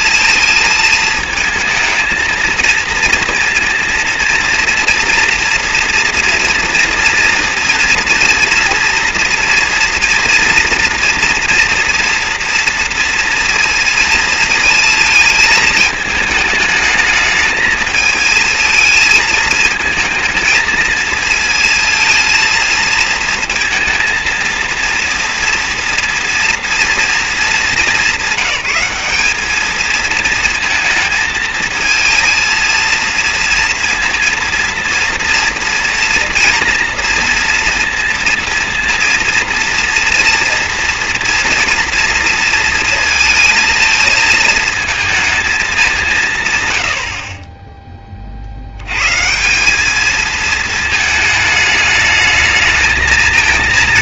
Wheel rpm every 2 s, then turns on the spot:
220, 230, 230, 230, 230, 230, 230, 220, 220, 220, 220, 230, 230, 220, 210, 230, 230, 230, 230, 230, 240, 230, 220, 60, 130, 220, 220.
none